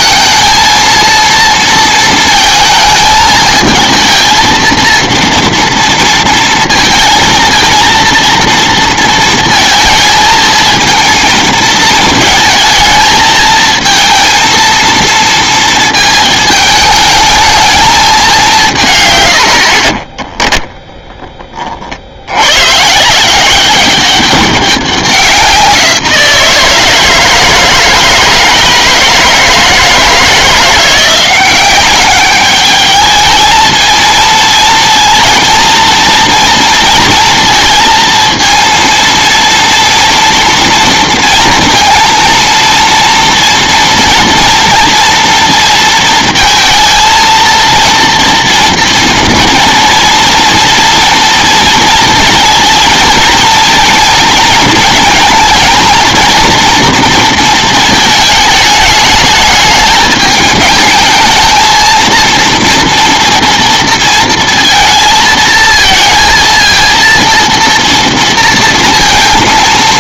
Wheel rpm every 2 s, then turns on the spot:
230, 220, 230, 230, 230, 230, 220, 230, 220, 150, 10, 140, 190, 160, 160, 170, 210, 230, 230, 230, 230, 230, 230, 230, 230, 230, 230, 220, 230, 210, 210, 230, 230, 230, 230.
none